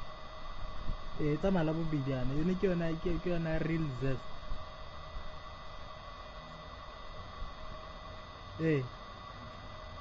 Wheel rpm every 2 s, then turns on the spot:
0, 0, 0, 0, 0.
none